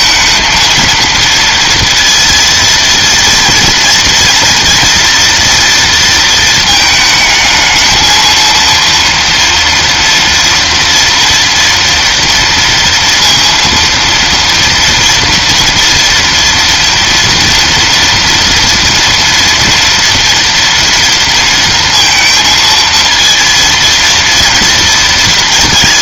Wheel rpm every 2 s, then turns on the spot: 230, 230, 230, 220, 230, 230, 230, 230, 230, 230, 230, 230, 230.
none